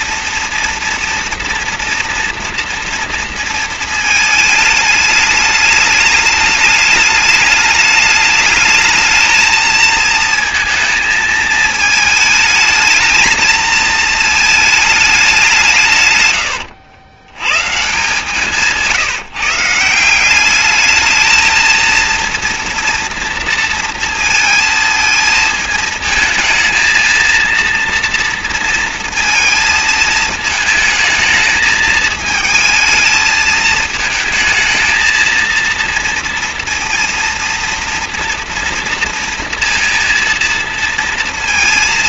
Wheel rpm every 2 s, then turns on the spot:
240, 230, 210, 210, 220, 230, 220, 220, 90, 160, 210, 230, 220, 230, 230, 220, 220, 220, 230, 230, 230.
none